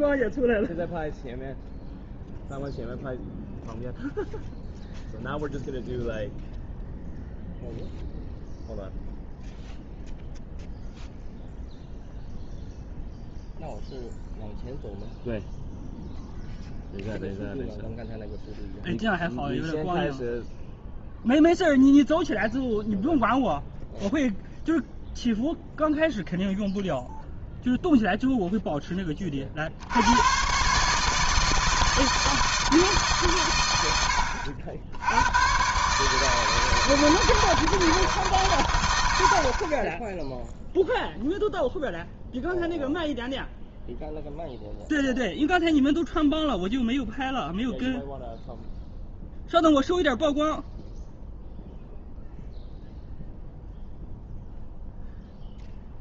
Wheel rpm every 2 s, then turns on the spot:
0, 0, 0, 0, 0, 0, 0, 0, 0, 0, 0, 0, 0, 0, 0, 130, 160, 80, 160, 130, 0, 0, 0, 0, 0, 0, 0, 0.
none